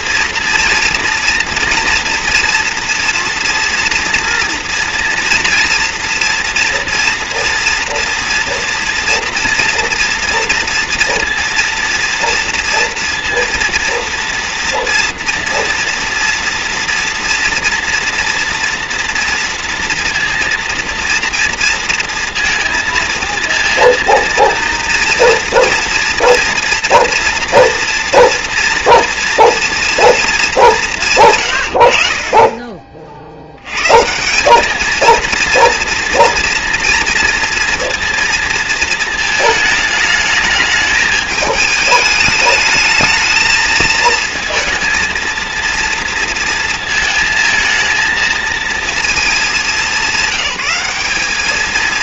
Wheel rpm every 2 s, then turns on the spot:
240, 230, 240, 230, 230, 230, 230, 230, 230, 230, 230, 230, 230, 240, 230, 190, 40, 210, 230, 230, 210, 220, 230, 230, 230, 200.
none